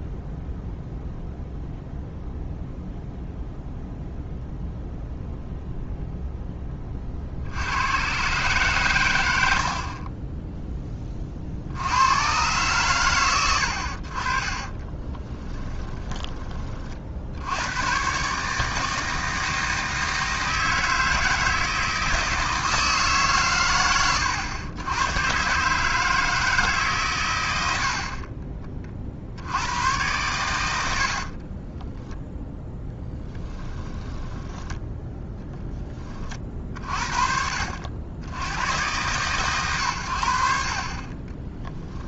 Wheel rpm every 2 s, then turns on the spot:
0, 0, 0, 30, 110, 20, 110, 10, 40, 160, 160, 150, 110, 140, 40, 80, 10, 10, 50, 110, 40.
14-16 30-32